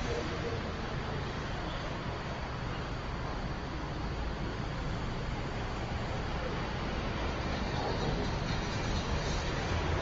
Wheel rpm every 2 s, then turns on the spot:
0, 0, 0, 0, 0.
none